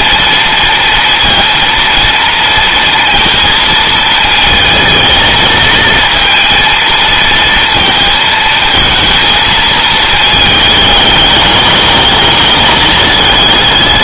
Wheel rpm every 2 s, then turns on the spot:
230, 230, 230, 230, 220, 210, 210.
none